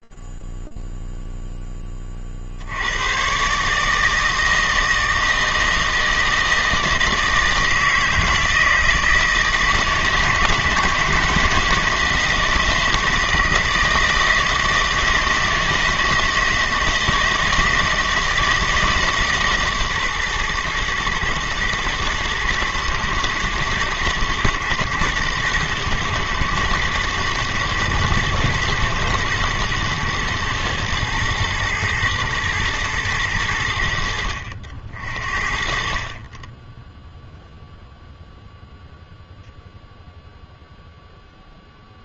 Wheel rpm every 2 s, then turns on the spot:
0, 20, 150, 160, 160, 160, 160, 160, 160, 160, 140, 110, 120, 110, 120, 120, 110, 80, 30, 0, 0.
none